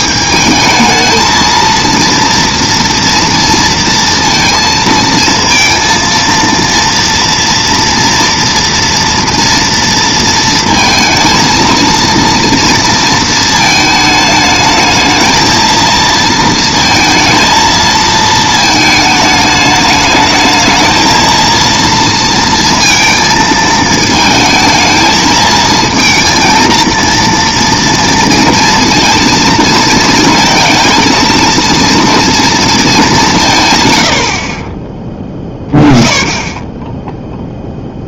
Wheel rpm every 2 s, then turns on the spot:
220, 230, 230, 230, 230, 230, 230, 220, 230, 220, 220, 230, 220, 230, 230, 230, 230, 40, 10.
none